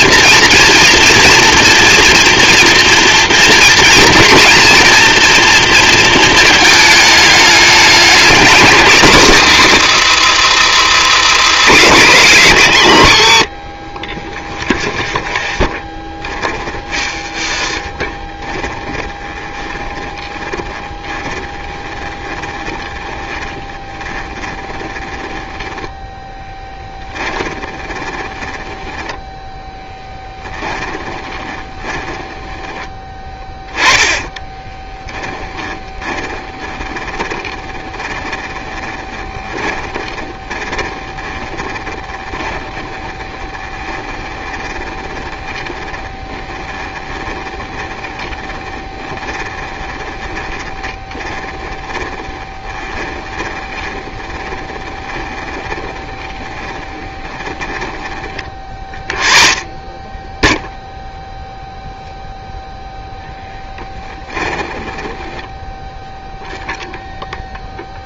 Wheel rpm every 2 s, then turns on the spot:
230, 230, 230, 220, 230, 180, 150, 30, 30, 20, 20, 20, 20, 10, 10, 10, 10, 10, 20, 20, 20, 20, 20, 20, 20, 20, 20, 20, 20, 20, 0, 0, 10, 0.
10-12 14-58 64-66